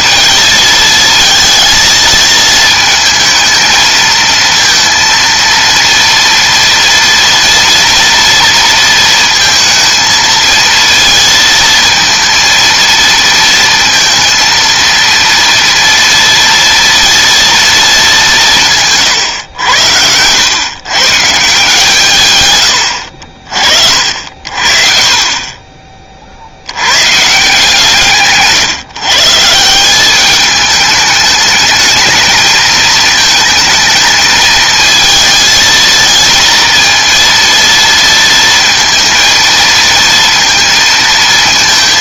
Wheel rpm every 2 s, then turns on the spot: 220, 220, 230, 230, 230, 230, 230, 230, 230, 160, 110, 110, 60, 90, 150, 210, 220, 220, 230, 230, 230.
none